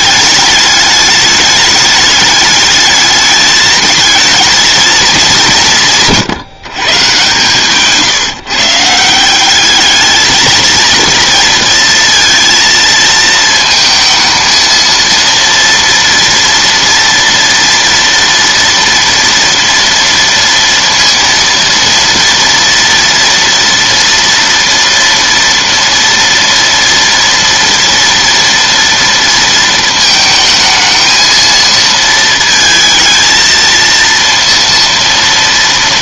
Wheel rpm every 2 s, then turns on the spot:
210, 210, 230, 140, 150, 230, 230, 230, 230, 230, 230, 230, 230, 230, 230, 220, 230, 230.
none